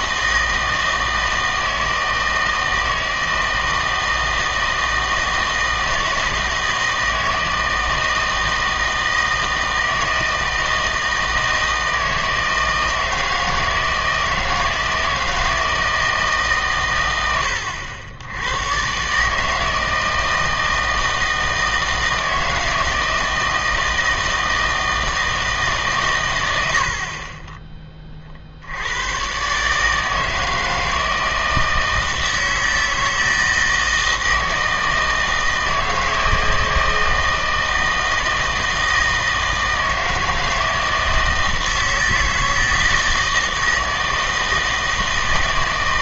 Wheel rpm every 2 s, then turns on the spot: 160, 160, 160, 160, 160, 160, 160, 160, 140, 110, 160, 160, 160, 70, 80, 160, 160, 160, 160, 160, 160, 160, 160.
26-28